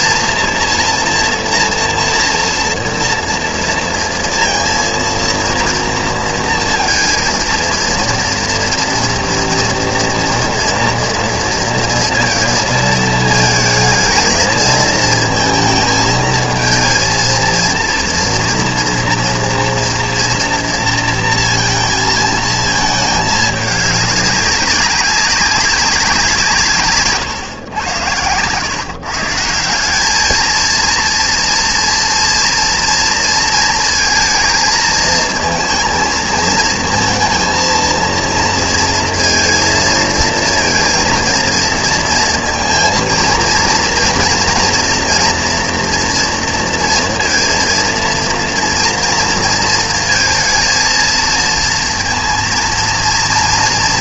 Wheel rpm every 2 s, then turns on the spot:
240, 230, 230, 230, 230, 240, 230, 220, 220, 240, 230, 220, 190, 150, 130, 230, 230, 230, 220, 230, 230, 230, 230, 230, 230, 230, 240.
none